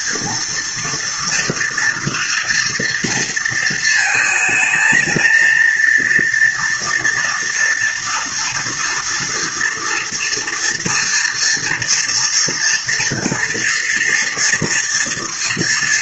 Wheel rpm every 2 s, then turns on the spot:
230, 230, 220, 230, 230, 240, 230, 230.
none